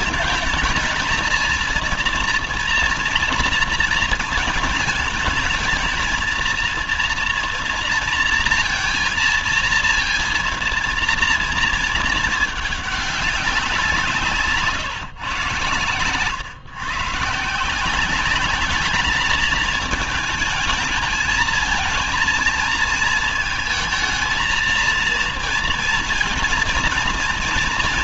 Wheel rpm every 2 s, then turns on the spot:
210, 230, 220, 220, 230, 230, 210, 160, 120, 200, 220, 220, 220, 230.
none